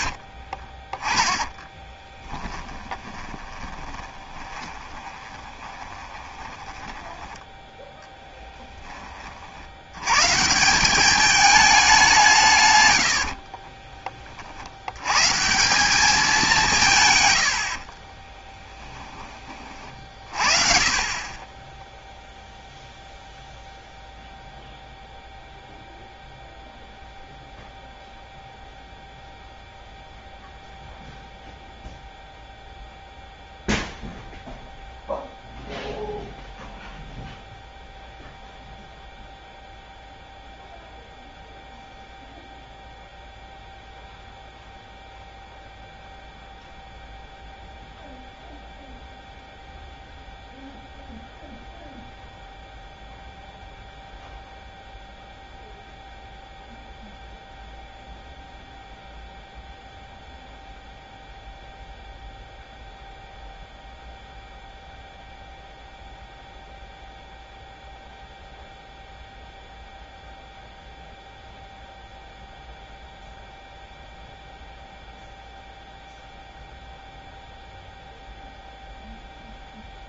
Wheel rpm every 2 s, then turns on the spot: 40, 20, 20, 20, 10, 180, 130, 70, 170, 10, 40, 0, 0, 0, 0, 0, 0, 0, 0, 0, 0, 0, 0, 0, 0, 0, 0, 0, 0, 0, 0, 0, 0, 0, 0, 0, 0, 0, 0, 0.
0-8 18-20